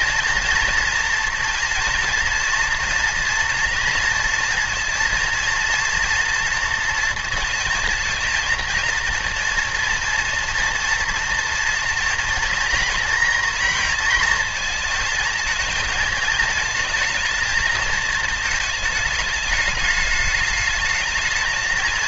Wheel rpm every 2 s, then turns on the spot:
230, 230, 230, 230, 230, 230, 230, 230, 220, 210, 220.
none